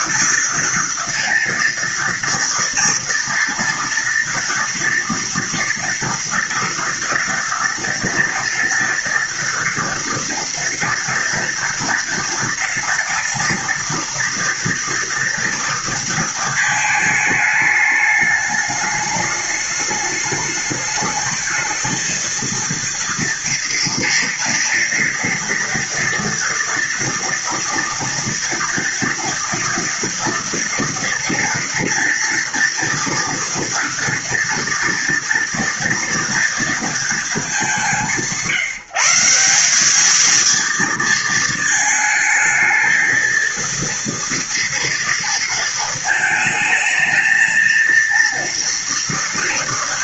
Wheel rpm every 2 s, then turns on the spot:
230, 230, 230, 230, 230, 230, 230, 230, 220, 210, 210, 230, 230, 230, 230, 230, 230, 240, 210, 170, 230, 230, 230, 220, 230.
none